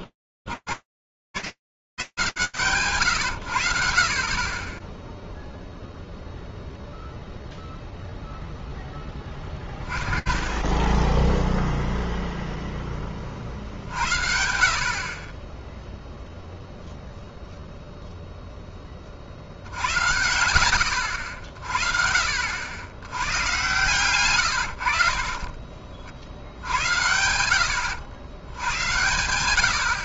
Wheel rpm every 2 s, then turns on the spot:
100, 10, 0, 10, 10, 10, 50, 0, 10, 70, 80, 90, 80, 90, 10.
2-4 22-24 28-30